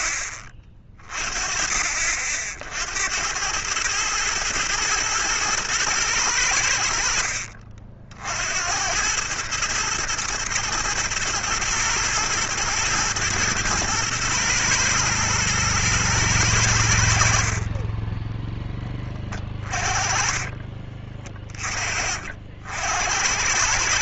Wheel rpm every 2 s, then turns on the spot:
30, 70, 110, 80, 80, 110, 110, 110, 90, 10, 30, 70.
20-22